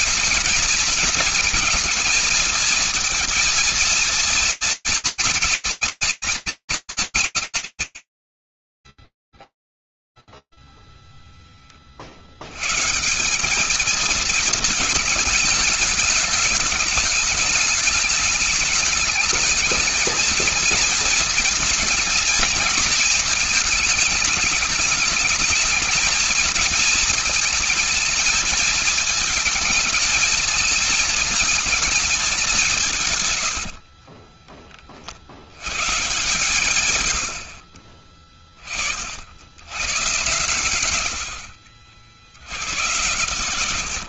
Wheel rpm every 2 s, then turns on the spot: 230, 230, 230, 180, 20, 0, 100, 220, 210, 210, 220, 220, 210, 220, 220, 220, 190, 40, 120, 50, 80, 110.
8-10 36-38